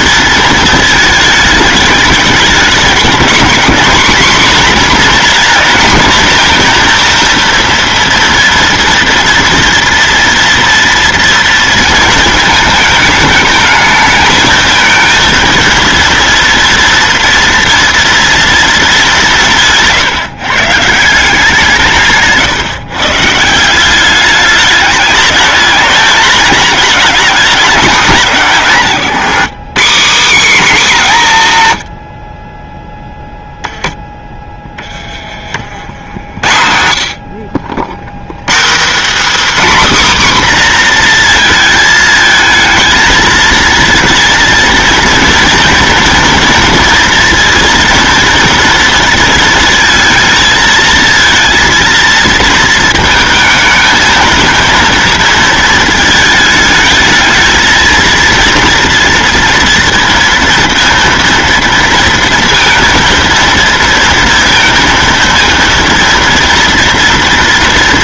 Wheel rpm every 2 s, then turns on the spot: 220, 210, 250, 230, 230, 230, 220, 230, 230, 210, 160, 140, 210, 230, 170, 250, 10, 20, 70, 240, 250, 220, 230, 230, 230, 220, 220, 230, 220, 230, 230, 230, 230, 230.
32-34